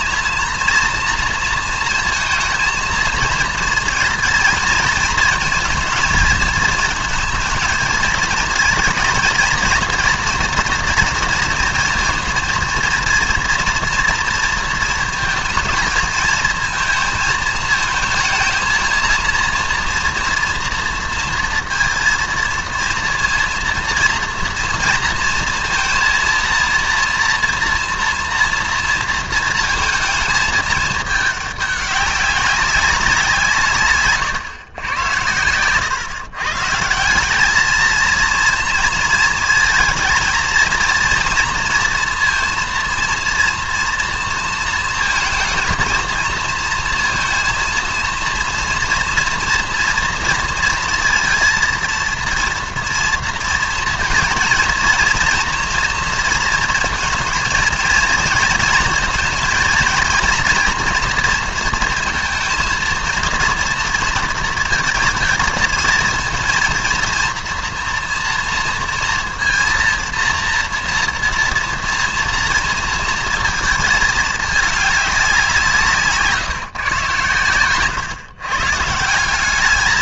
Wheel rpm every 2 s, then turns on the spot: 230, 230, 230, 220, 230, 230, 230, 230, 220, 230, 230, 230, 230, 230, 230, 220, 200, 110, 150, 230, 230, 230, 230, 230, 230, 230, 230, 230, 230, 230, 240, 230, 230, 230, 230, 230, 230, 210, 140, 130.
none